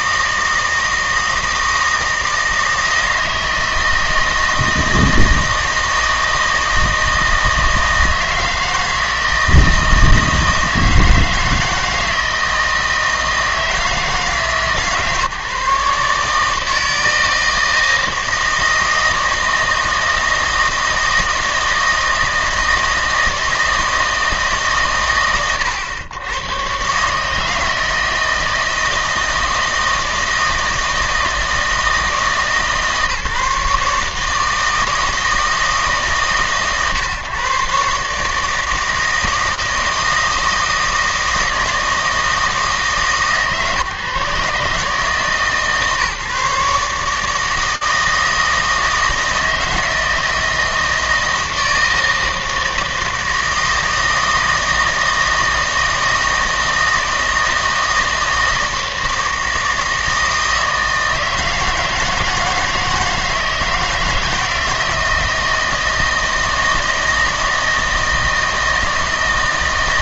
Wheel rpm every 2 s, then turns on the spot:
160, 160, 160, 160, 160, 160, 160, 150, 160, 160, 160, 160, 120, 130, 160, 160, 150, 160, 120, 160, 160, 150, 150, 140, 160, 160, 160, 160, 160, 160, 160, 160, 160, 160, 160.
none